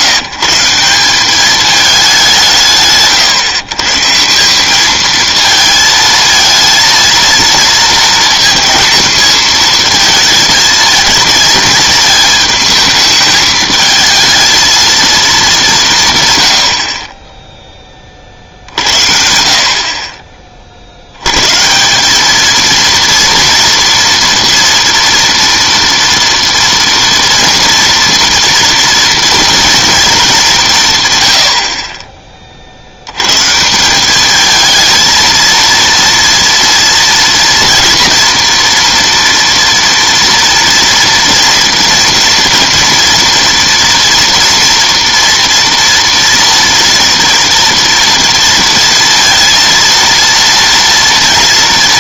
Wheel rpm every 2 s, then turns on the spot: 170, 160, 180, 230, 230, 220, 220, 220, 110, 50, 30, 220, 240, 230, 230, 190, 40, 220, 230, 230, 230, 230, 230, 230, 230, 230.
none